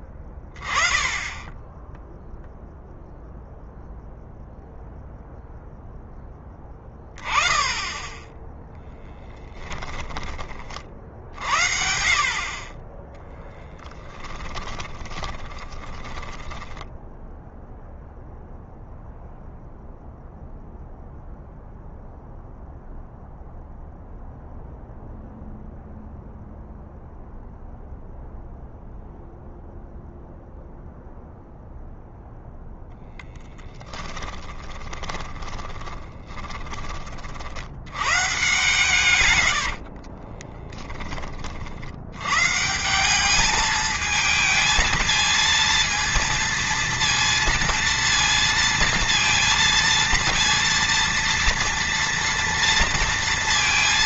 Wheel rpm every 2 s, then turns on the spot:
20, 0, 0, 10, 10, 40, 30, 20, 10, 0, 0, 0, 0, 0, 0, 0, 10, 20, 30, 130, 20, 170, 220, 230, 230, 230, 230.
8-10 12-18 34-36 38-40